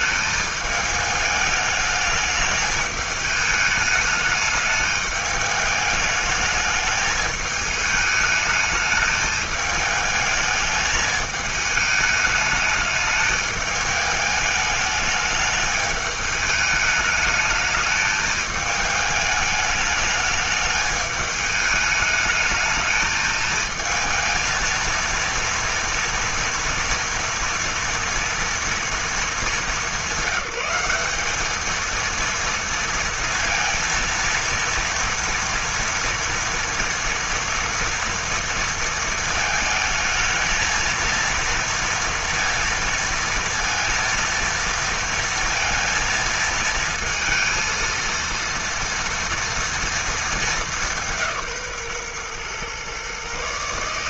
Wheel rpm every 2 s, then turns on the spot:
210, 210, 210, 220, 210, 210, 210, 210, 210, 210, 210, 220, 230, 230, 220, 200, 230, 230, 230, 230, 220, 230, 230, 220, 230, 190, 130.
none